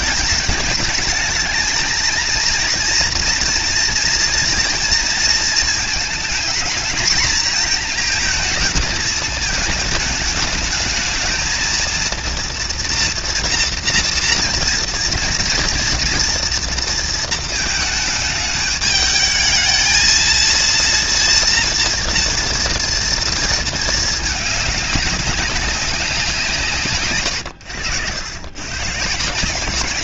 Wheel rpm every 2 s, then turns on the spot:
220, 240, 230, 230, 220, 220, 230, 230, 230, 210, 230, 230, 210, 150, 140.
none